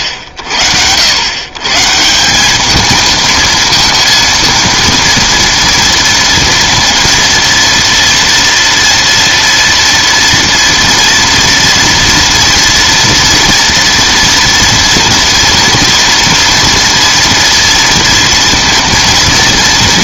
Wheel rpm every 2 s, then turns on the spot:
70, 210, 230, 230, 230, 230, 230, 230, 230, 240.
none